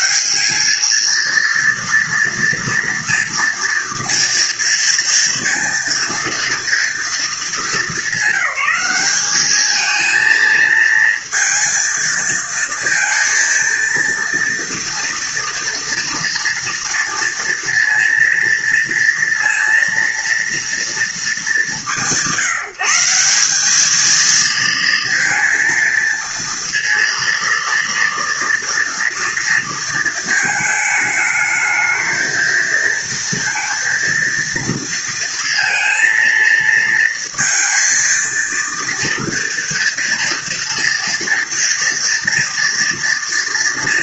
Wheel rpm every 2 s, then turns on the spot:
230, 230, 230, 220, 200, 230, 230, 240, 230, 230, 190, 180, 230, 230, 230, 210, 230, 230, 230, 230, 240, 230.
none